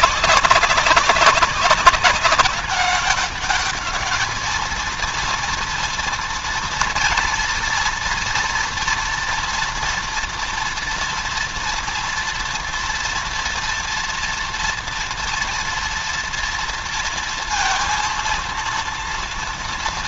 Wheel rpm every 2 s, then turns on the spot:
190, 200, 230, 230, 240, 230, 230, 230, 230, 230.
none